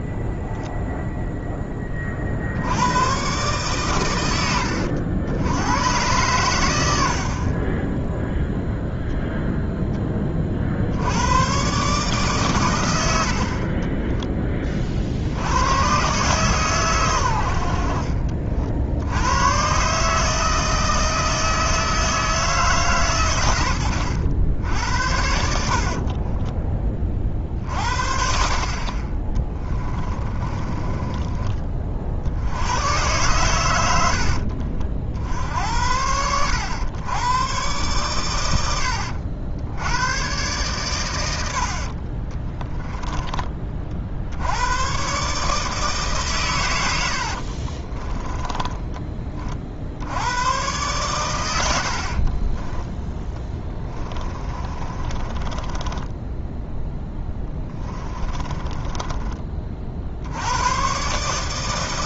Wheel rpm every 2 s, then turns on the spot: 0, 70, 90, 90, 0, 50, 120, 30, 130, 50, 160, 150, 80, 30, 50, 20, 90, 70, 90, 100, 130, 20, 100, 110, 10, 120, 10, 30, 10, 20, 90.
4-6 30-32 38-40 42-44 48-50 52-60